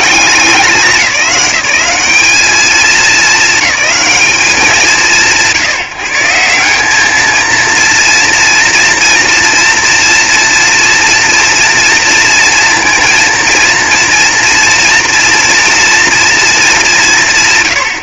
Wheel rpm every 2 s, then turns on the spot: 190, 220, 180, 200, 230, 240, 230, 240, 220.
none